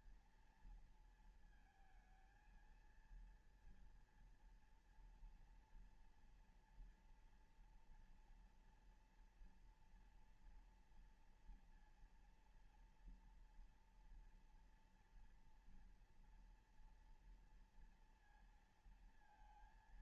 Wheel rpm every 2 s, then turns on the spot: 230, 220, 230, 230, 230, 230, 230, 230, 240, 230.
none